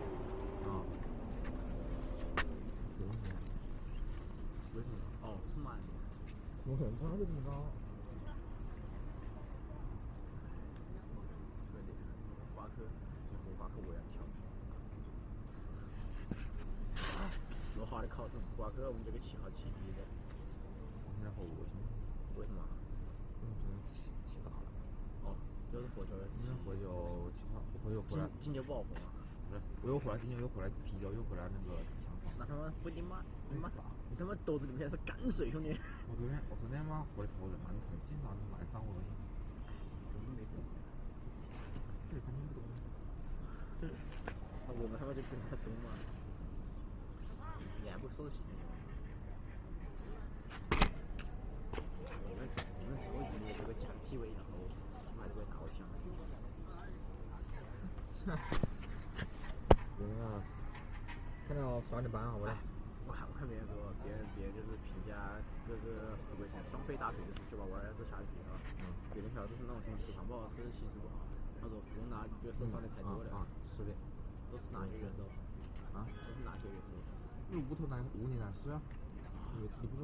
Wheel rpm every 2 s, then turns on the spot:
0, 0, 0, 0, 0, 0, 0, 0, 0, 0, 0, 0, 0, 0, 0, 0, 0, 0, 0, 0, 0, 0, 0, 0, 0, 0, 0, 0, 0, 0, 0, 0, 0, 0, 0, 0, 0, 0, 0, 0.
none